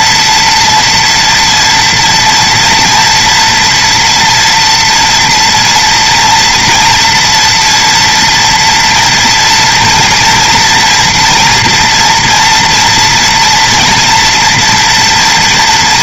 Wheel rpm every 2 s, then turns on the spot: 230, 230, 230, 230, 240, 230, 230, 230.
none